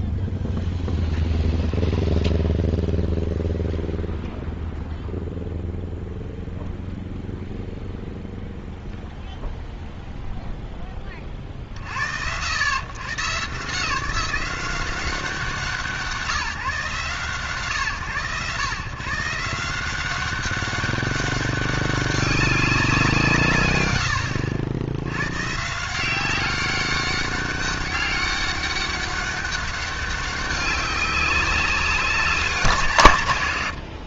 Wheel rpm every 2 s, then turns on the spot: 0, 0, 0, 0, 0, 0, 130, 180, 150, 140, 200, 180, 100, 200, 200, 200, 170.
none